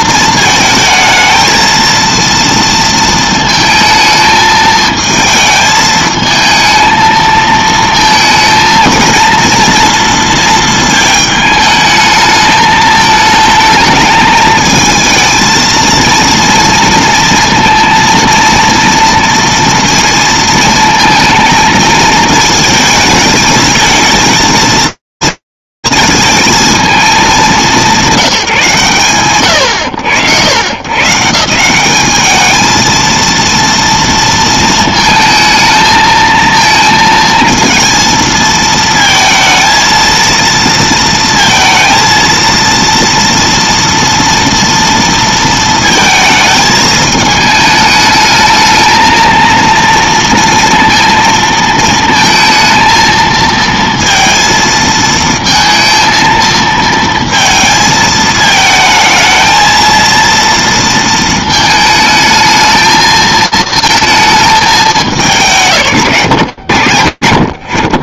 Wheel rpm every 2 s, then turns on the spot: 220, 230, 220, 220, 230, 220, 220, 220, 230, 230, 230, 220, 220, 180, 110, 200, 230, 220, 220, 230, 230, 230, 230, 220, 230, 230, 230, 230, 220, 230, 220, 220, 130, 60.
none